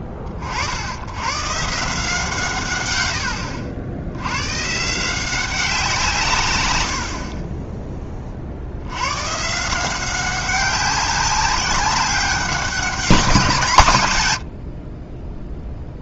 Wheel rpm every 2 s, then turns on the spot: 50, 140, 120, 130, 40, 190, 200, 90.
none